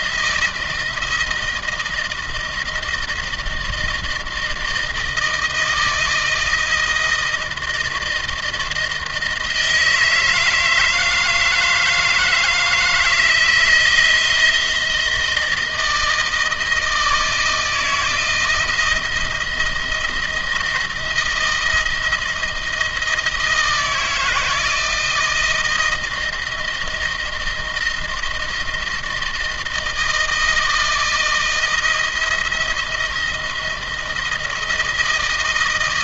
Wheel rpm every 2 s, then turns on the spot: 160, 160, 160, 170, 160, 160, 160, 160, 160, 170, 170, 160, 160, 160, 160, 160, 170, 160.
none